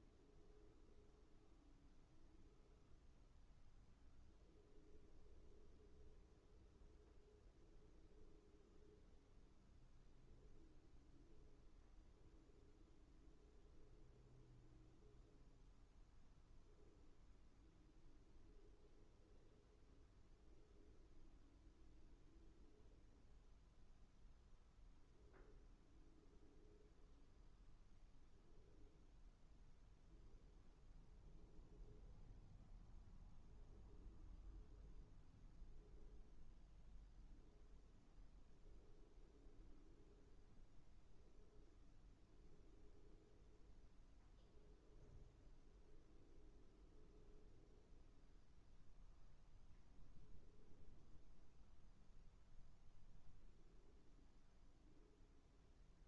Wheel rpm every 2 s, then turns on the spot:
0, 0, 0, 0, 0, 0, 0, 0, 0, 0, 0, 0, 0, 0, 0, 0, 0, 0, 0, 0, 0, 0, 0, 0, 0, 0, 0, 0.
none